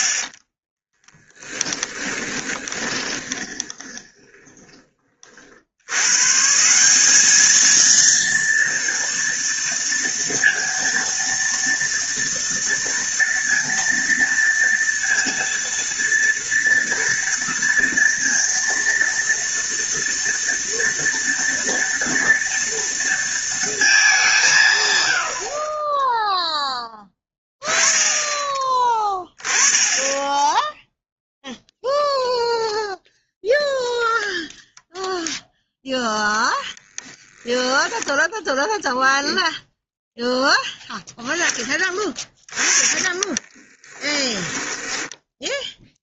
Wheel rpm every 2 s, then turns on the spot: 20, 20, 20, 160, 230, 230, 230, 230, 230, 230, 230, 230, 170, 0, 10, 10, 0, 0, 10, 10, 0, 20, 10.
0-6 36-38 42-46